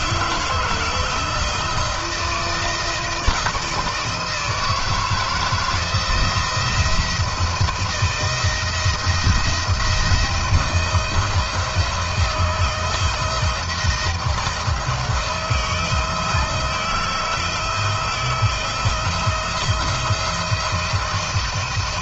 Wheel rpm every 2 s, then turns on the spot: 170, 170, 170, 170, 170, 170, 160, 160, 160, 160, 170.
none